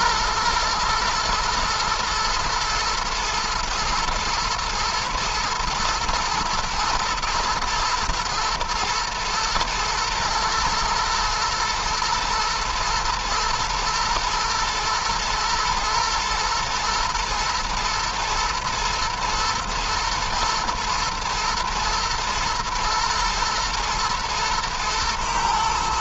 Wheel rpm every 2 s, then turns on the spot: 110, 110, 120, 110, 120, 110, 110, 120, 110, 120, 110, 110, 110.
none